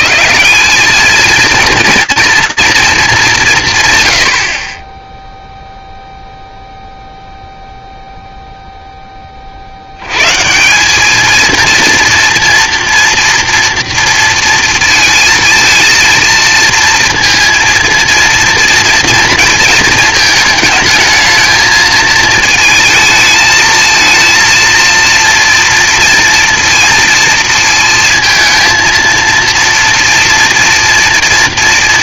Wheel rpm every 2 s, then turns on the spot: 190, 230, 30, 0, 10, 190, 240, 230, 230, 230, 220, 220, 230, 230, 220, 230.
none